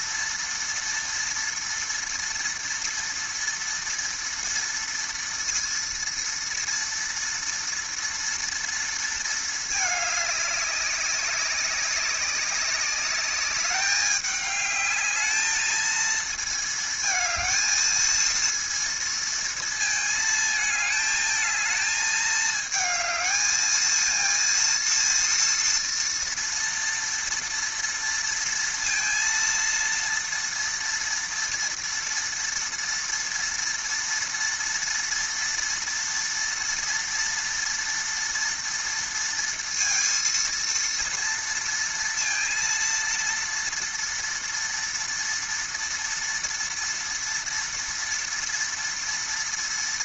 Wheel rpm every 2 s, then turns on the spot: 230, 230, 230, 230, 230, 200, 200, 210, 220, 230, 220, 220, 230, 230, 230, 230, 230, 230, 230, 230, 230, 230, 230, 230, 230.
none